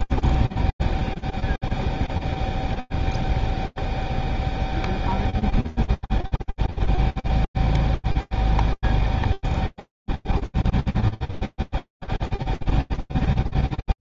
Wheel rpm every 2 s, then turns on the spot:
0, 0, 0, 0, 0, 0, 0.
none